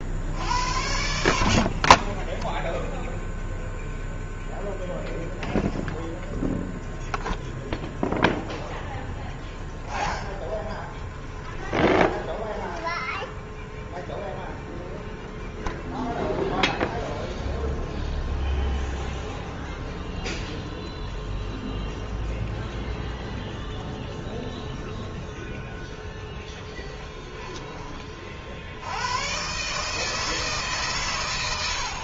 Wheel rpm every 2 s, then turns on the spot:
70, 10, 0, 0, 0, 10, 10, 0, 0, 0, 0, 0, 0, 0, 60, 150.
12-14